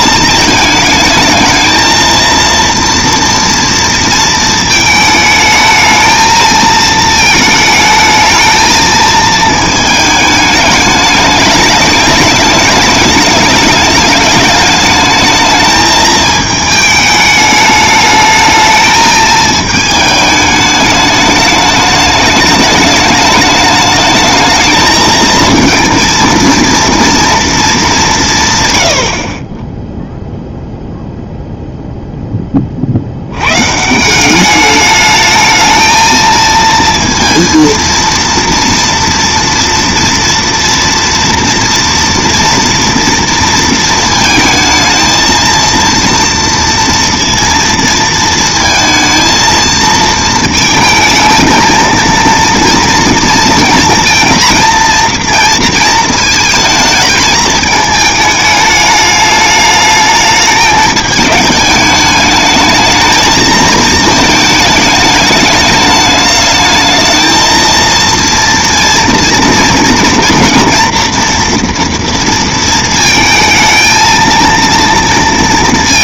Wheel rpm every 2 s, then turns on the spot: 220, 230, 220, 220, 220, 210, 210, 210, 220, 220, 210, 210, 220, 230, 100, 0, 20, 200, 230, 230, 230, 230, 220, 230, 230, 220, 230, 230, 220, 210, 220, 220, 220, 220, 230, 230, 230, 230.
none